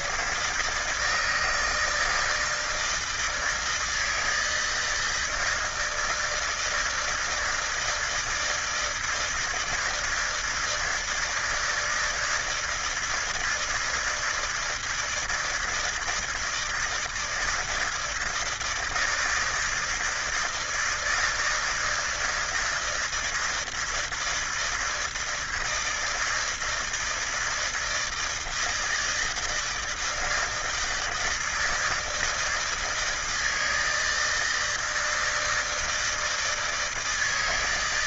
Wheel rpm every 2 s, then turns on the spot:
140, 160, 160, 160, 160, 160, 160, 160, 160, 160, 160, 160, 160, 160, 160, 160, 160, 160, 160.
none